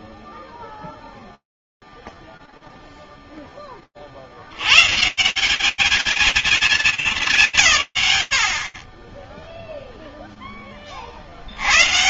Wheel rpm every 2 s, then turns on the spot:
0, 0, 10, 180, 70, 10.
none